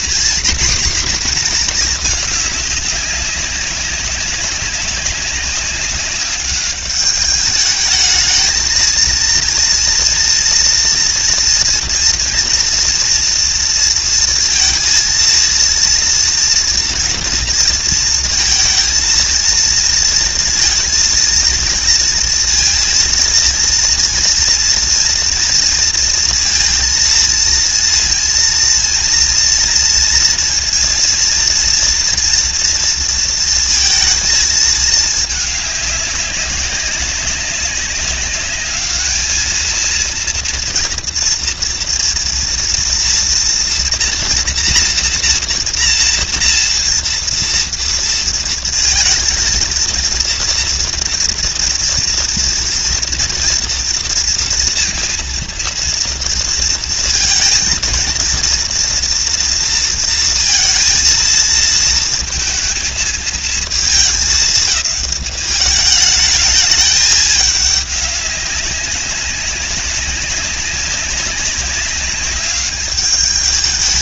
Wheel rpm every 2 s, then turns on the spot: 230, 200, 200, 200, 230, 240, 230, 230, 230, 230, 230, 230, 230, 230, 230, 230, 230, 210, 190, 210, 230, 240, 240, 230, 230, 230, 230, 230, 230, 240, 220, 220, 210, 210, 200, 190, 210.
none